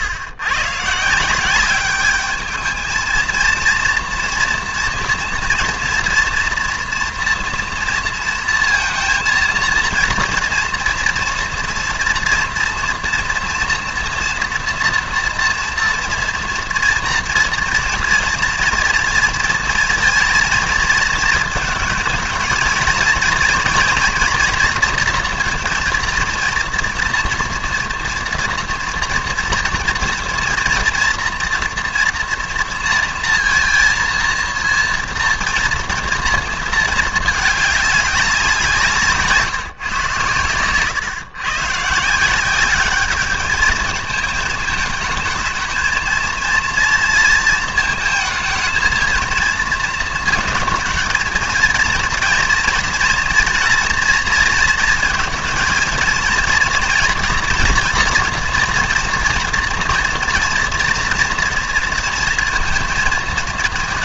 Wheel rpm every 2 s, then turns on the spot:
130, 220, 240, 240, 230, 240, 230, 230, 230, 230, 230, 230, 230, 230, 230, 230, 230, 230, 230, 180, 110, 190, 210, 230, 220, 230, 230, 230, 230, 230, 240, 230.
none